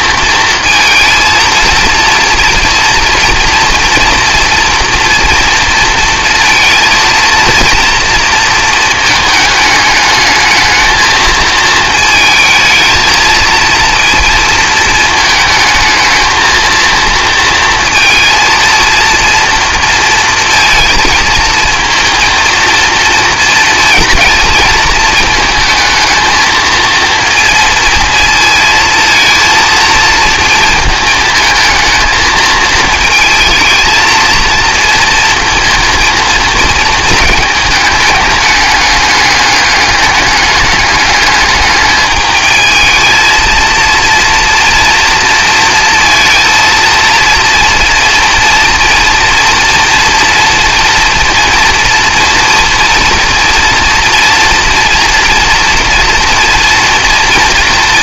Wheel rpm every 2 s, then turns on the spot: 220, 230, 240, 230, 230, 220, 220, 220, 230, 230, 230, 230, 220, 230, 230, 220, 220, 230, 220, 210, 200, 220, 230, 230, 230, 230, 230, 230, 230.
none